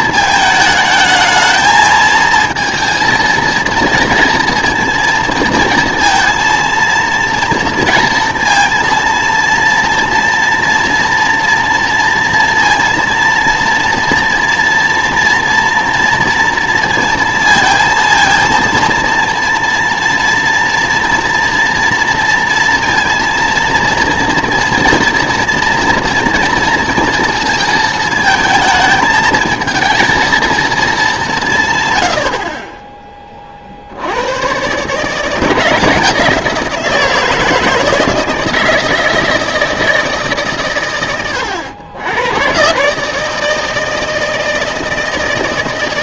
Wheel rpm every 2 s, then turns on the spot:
220, 230, 230, 230, 230, 230, 230, 230, 230, 230, 230, 230, 230, 230, 220, 230, 40, 120, 170, 160, 130, 120, 160.
none